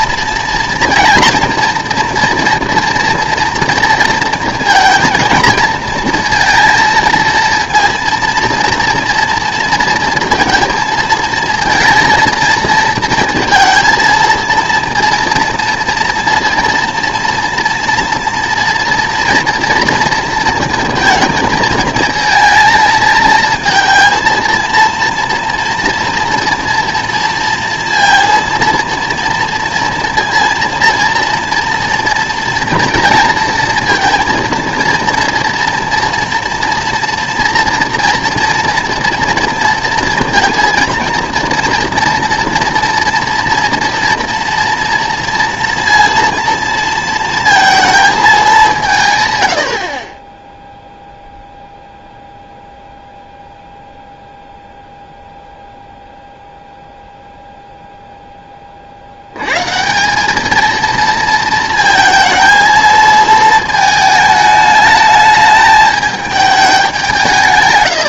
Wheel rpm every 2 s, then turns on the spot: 230, 240, 230, 230, 230, 230, 230, 230, 230, 230, 230, 220, 230, 230, 230, 230, 230, 230, 230, 240, 230, 240, 230, 230, 200, 0, 0, 0, 0, 10, 220, 230, 210, 210.
none